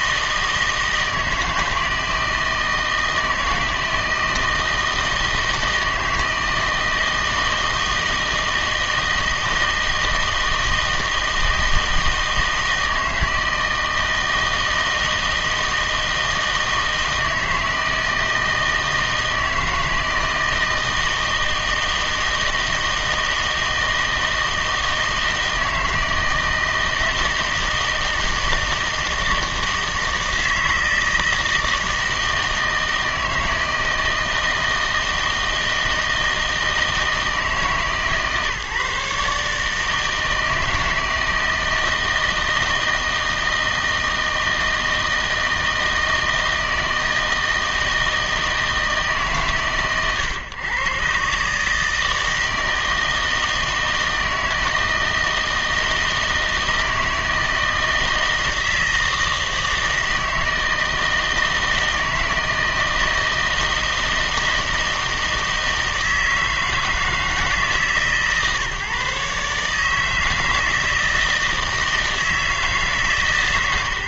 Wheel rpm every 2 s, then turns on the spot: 160, 160, 160, 160, 160, 160, 160, 160, 160, 160, 160, 160, 160, 160, 160, 160, 160, 160, 160, 150, 160, 160, 160, 160, 160, 120, 160, 160, 160, 160, 160, 160, 160, 160, 140, 160, 160.
none